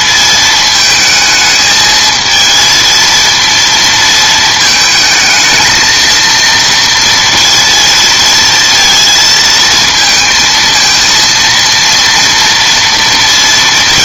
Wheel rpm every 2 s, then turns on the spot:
220, 220, 220, 230, 230, 230, 230.
none